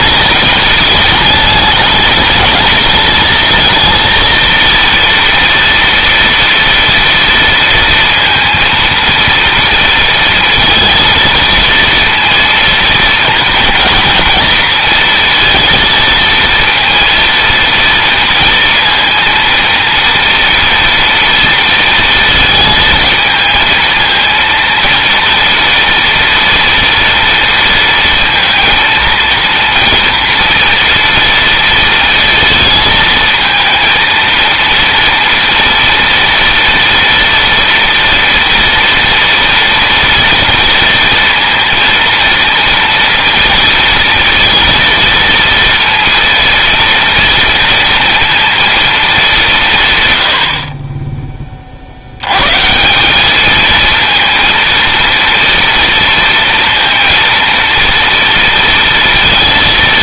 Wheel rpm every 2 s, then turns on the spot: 220, 220, 230, 230, 230, 230, 230, 230, 230, 230, 230, 220, 230, 230, 230, 230, 230, 230, 230, 240, 230, 230, 230, 230, 220, 30, 170, 230, 230, 230.
none